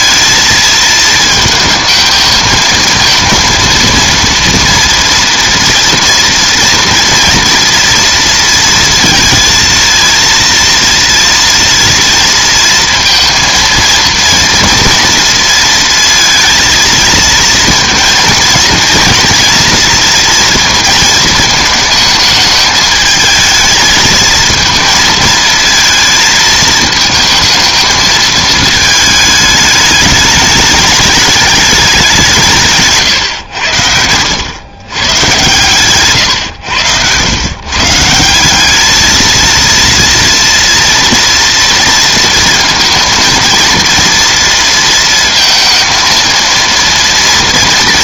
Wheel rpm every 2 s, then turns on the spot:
220, 220, 230, 230, 230, 230, 230, 230, 220, 230, 230, 210, 230, 220, 220, 210, 160, 110, 100, 200, 230, 230, 230, 230.
36-38